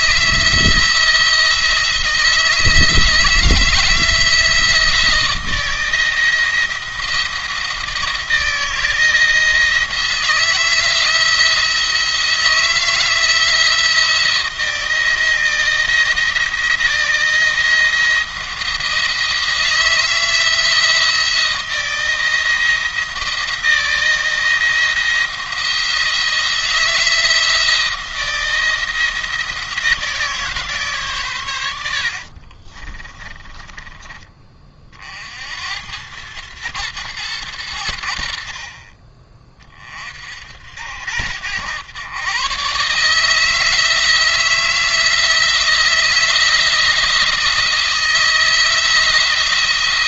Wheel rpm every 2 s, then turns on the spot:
160, 160, 160, 160, 160, 160, 160, 170, 170, 170, 170, 170, 170, 160, 170, 140, 40, 30, 110, 40, 70, 140, 160, 170, 170.
32-34